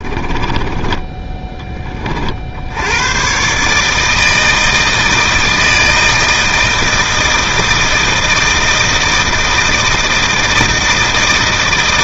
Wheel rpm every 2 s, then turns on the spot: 20, 60, 160, 160, 160, 160.
0-2